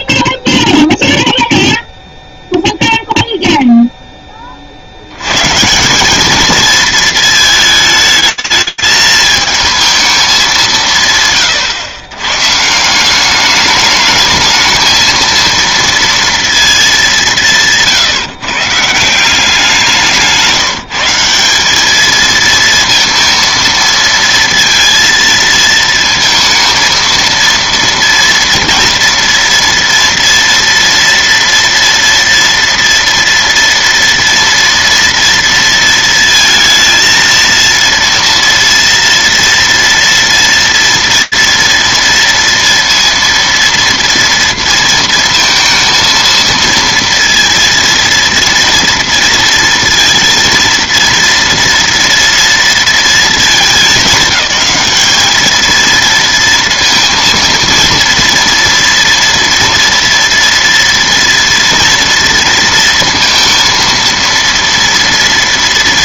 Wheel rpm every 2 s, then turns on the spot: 0, 0, 40, 220, 220, 180, 150, 220, 220, 150, 180, 230, 230, 220, 230, 230, 230, 230, 230, 230, 230, 230, 230, 230, 230, 230, 230, 210, 230, 230, 230, 230, 230.
none